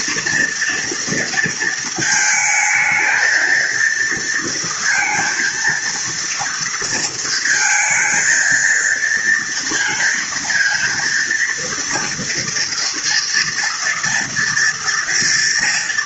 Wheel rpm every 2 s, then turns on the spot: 230, 220, 230, 230, 230, 230, 230, 240.
none